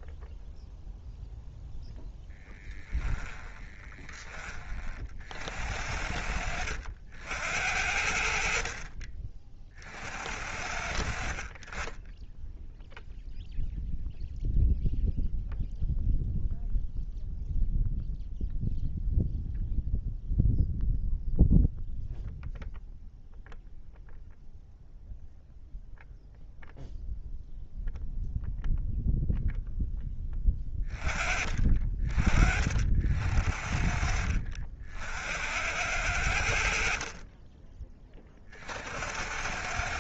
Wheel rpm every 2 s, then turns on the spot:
0, 10, 50, 70, 40, 70, 0, 0, 0, 0, 0, 0, 0, 0, 0, 20, 60, 70, 50, 70.
2-4